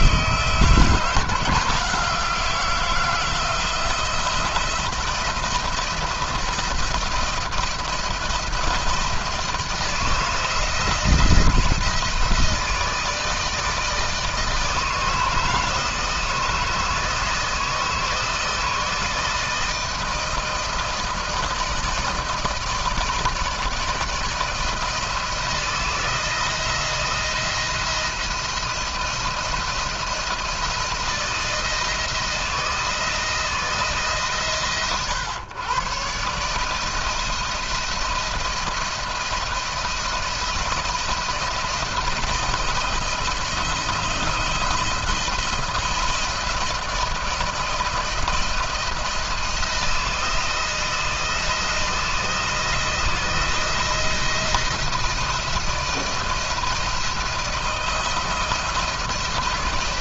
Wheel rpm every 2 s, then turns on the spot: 160, 170, 170, 170, 160, 160, 160, 160, 160, 160, 160, 160, 160, 170, 170, 160, 160, 130, 150, 170, 170, 170, 170, 170, 170, 170, 170, 170, 170, 170.
none